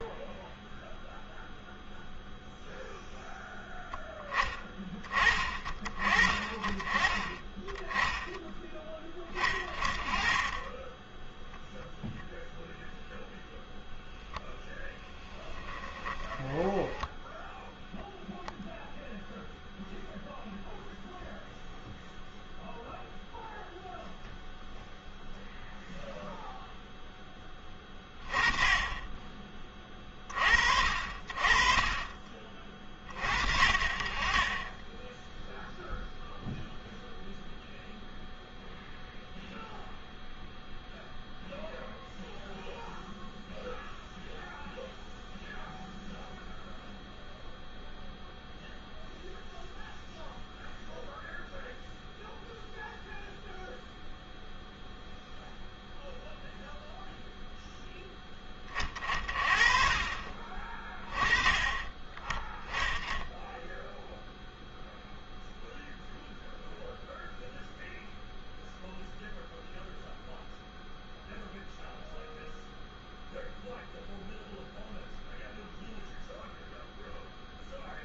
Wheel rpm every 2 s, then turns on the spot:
0, 0, 40, 20, 20, 10, 0, 10, 10, 0, 0, 0, 0, 10, 10, 50, 40, 10, 0, 0, 0, 0, 0, 0, 0, 0, 0, 0, 0, 30, 30, 10, 0, 0, 0, 0, 0, 0, 0.
14-18